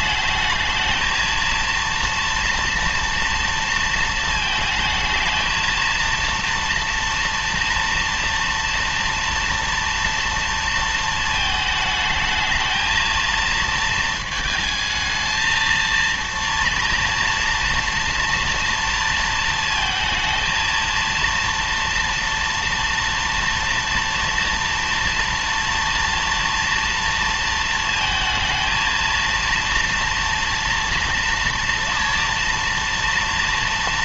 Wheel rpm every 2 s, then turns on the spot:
220, 240, 220, 230, 230, 230, 220, 220, 230, 230, 230, 230, 230, 230, 220, 230, 230.
none